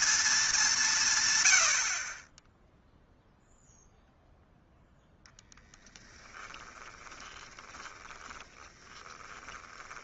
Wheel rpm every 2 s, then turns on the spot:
190, 0, 0, 20, 20.
6-10